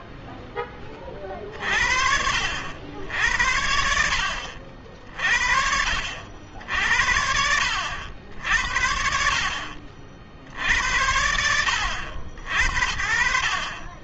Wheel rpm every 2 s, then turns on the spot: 20, 60, 60, 70, 60, 70, 80.
none